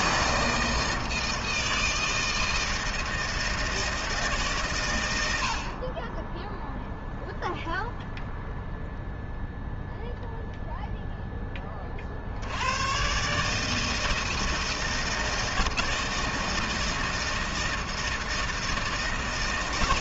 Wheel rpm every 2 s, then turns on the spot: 140, 160, 130, 0, 0, 0, 90, 160, 160, 160.
none